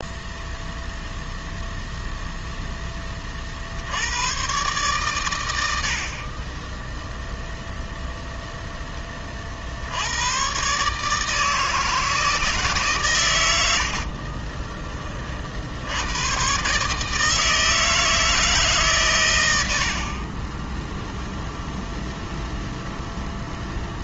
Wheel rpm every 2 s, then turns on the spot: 0, 20, 120, 0, 10, 150, 130, 20, 150, 120, 0, 0.
none